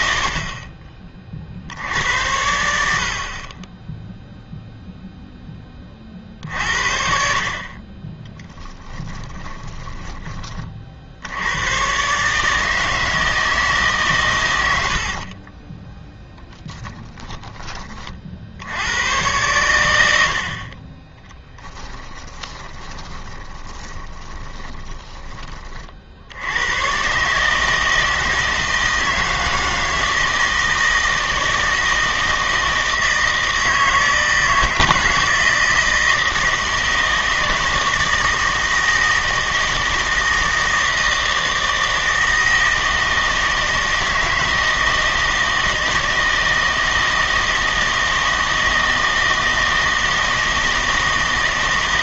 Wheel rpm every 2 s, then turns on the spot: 40, 80, 0, 50, 20, 40, 150, 90, 10, 80, 40, 20, 10, 100, 160, 160, 160, 160, 160, 160, 160, 160, 160, 160, 160, 160.
8-10 22-26